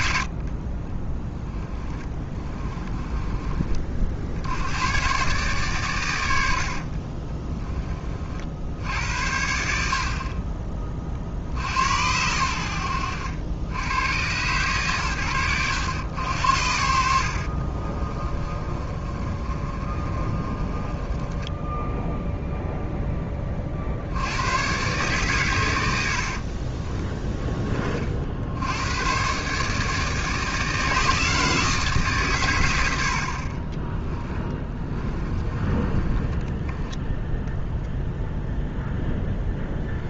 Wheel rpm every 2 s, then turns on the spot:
30, 20, 100, 60, 70, 30, 90, 130, 70, 30, 20, 0, 120, 30, 90, 160, 110, 20, 10, 0.
0-4 6-8 18-22 26-28 34-38